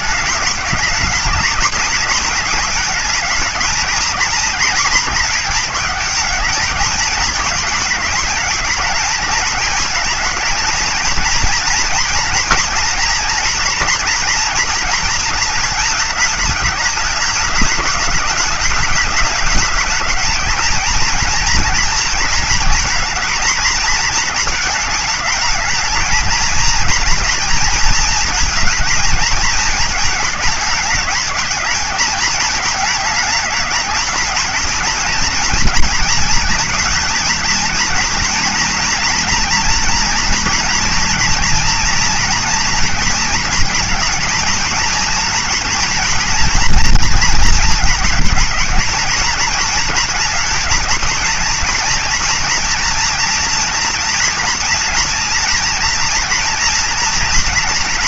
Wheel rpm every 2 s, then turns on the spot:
210, 220, 240, 220, 220, 220, 220, 230, 210, 210, 220, 230, 230, 220, 230, 210, 220, 220, 230, 230, 230, 230, 230, 230, 220, 230, 230, 230, 230.
none